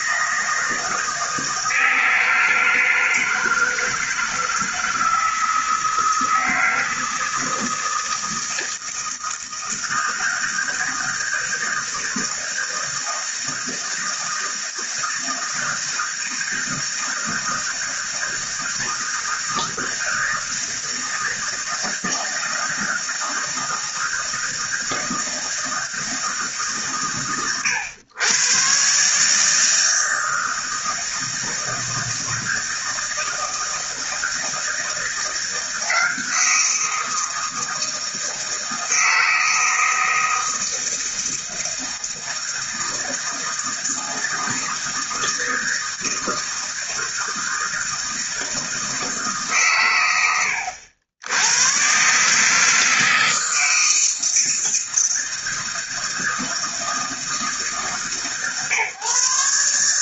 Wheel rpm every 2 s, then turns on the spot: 160, 160, 160, 160, 160, 160, 160, 160, 160, 160, 160, 160, 160, 130, 120, 160, 160, 160, 170, 160, 160, 160, 160, 160, 160, 90, 150, 160, 160, 140.
none